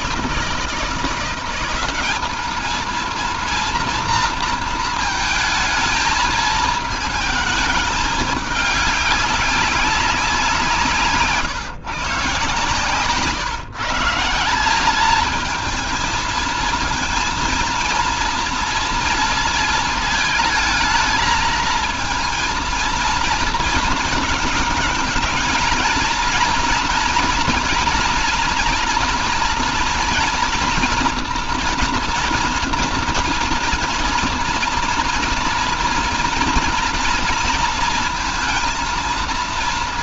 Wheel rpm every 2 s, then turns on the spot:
170, 210, 230, 220, 200, 180, 160, 180, 220, 230, 220, 230, 220, 230, 230, 230, 230, 240, 230, 230.
none